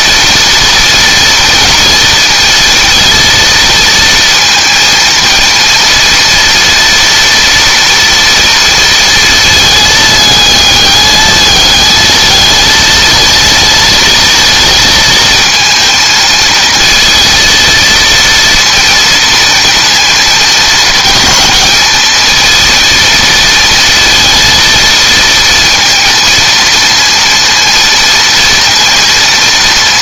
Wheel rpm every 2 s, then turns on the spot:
230, 230, 230, 230, 230, 210, 220, 220, 230, 220, 220, 230, 230, 230, 230.
none